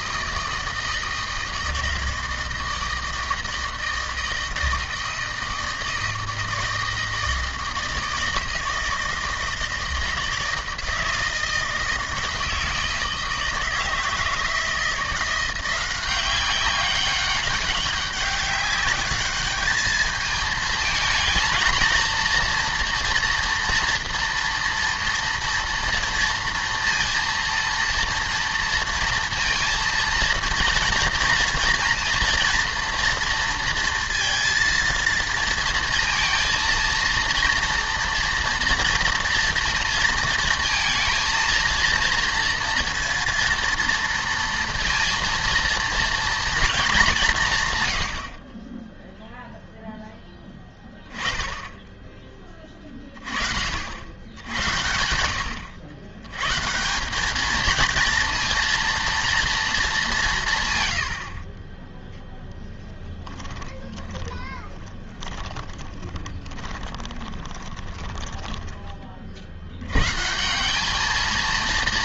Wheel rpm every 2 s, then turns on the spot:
160, 160, 160, 160, 160, 160, 160, 160, 200, 200, 220, 230, 230, 230, 230, 230, 230, 230, 230, 230, 230, 230, 230, 220, 20, 10, 20, 90, 140, 230, 120, 10, 30, 30, 10, 190.
64-68